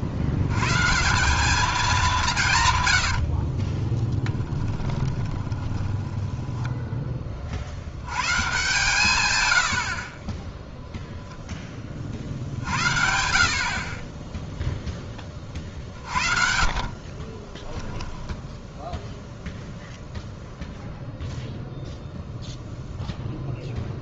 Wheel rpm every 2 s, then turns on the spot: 120, 130, 10, 10, 130, 10, 60, 10, 60, 0, 0, 0.
4-8 10-12 16-18